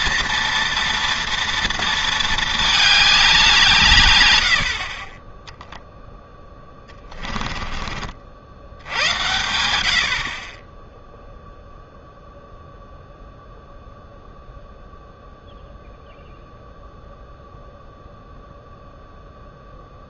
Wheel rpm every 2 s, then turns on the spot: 230, 220, 60, 10, 70, 40, 0, 0, 0, 0.
6-8